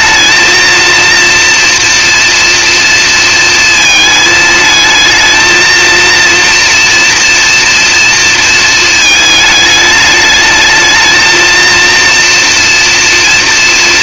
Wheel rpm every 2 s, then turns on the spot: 230, 230, 220, 230, 220, 220, 230.
none